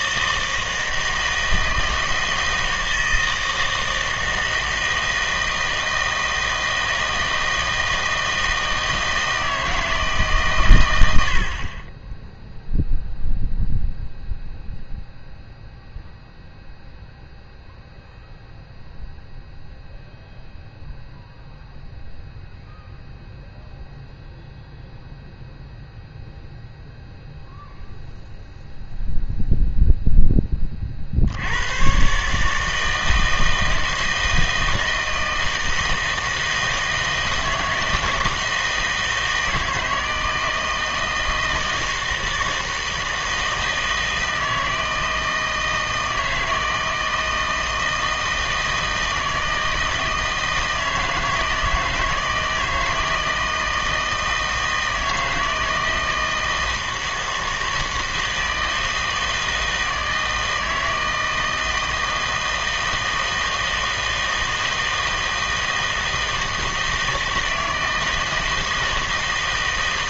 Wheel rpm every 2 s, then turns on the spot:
160, 160, 160, 160, 160, 120, 0, 0, 0, 0, 0, 0, 0, 0, 0, 20, 150, 160, 160, 160, 160, 160, 160, 160, 160, 160, 160, 160, 160, 160, 160, 160, 160, 160, 160.
none